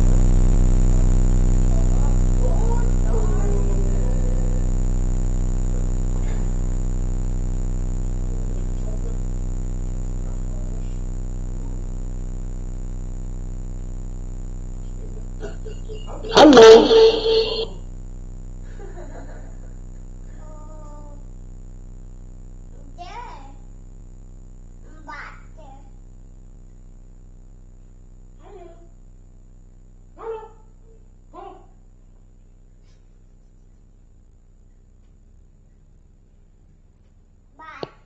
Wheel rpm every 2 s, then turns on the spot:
0, 0, 0, 0, 0, 0, 0, 0, 0, 0, 0, 0, 0, 0, 0, 0, 0, 0, 0.
none